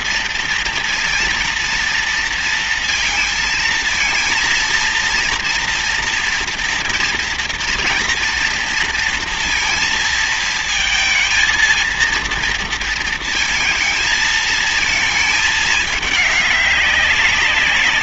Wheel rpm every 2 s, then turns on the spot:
230, 230, 230, 230, 230, 230, 230, 230, 210.
none